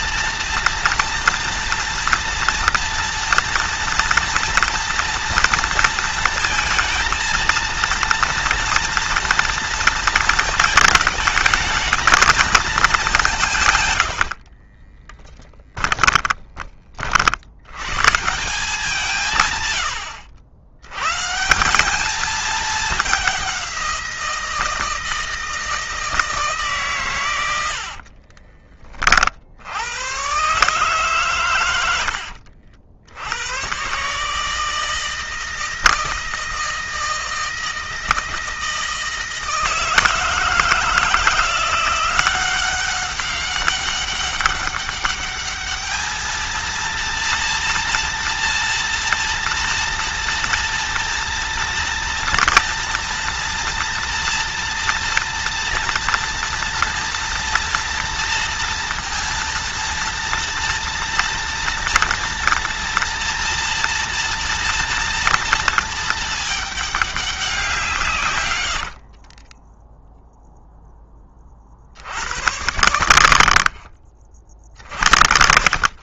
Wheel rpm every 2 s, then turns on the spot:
230, 230, 230, 230, 230, 220, 220, 30, 40, 160, 120, 210, 160, 130, 30, 130, 70, 160, 160, 160, 160, 190, 200, 230, 230, 230, 230, 230, 230, 230, 230, 230, 230, 210, 60, 10, 90, 50.
14-16 68-70